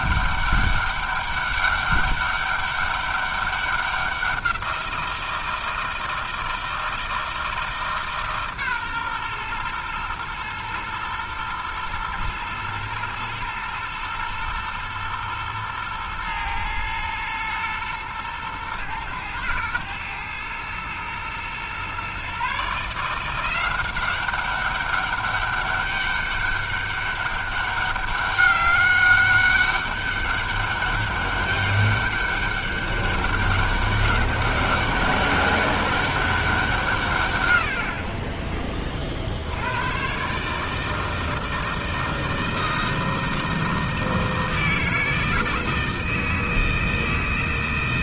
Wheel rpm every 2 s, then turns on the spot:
200, 200, 180, 160, 140, 120, 110, 110, 110, 110, 110, 150, 190, 200, 200, 200, 200, 200, 170, 30, 150, 160, 160, 160.
none